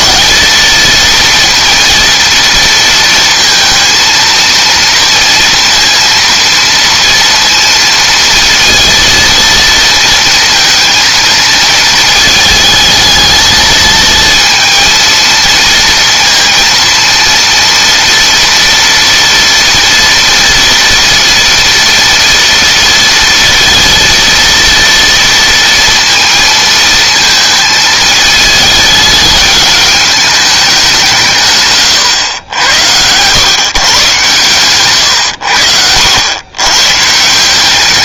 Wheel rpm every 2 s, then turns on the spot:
230, 230, 230, 230, 230, 230, 220, 230, 230, 230, 230, 230, 230, 230, 210, 180, 100, 120, 130.
none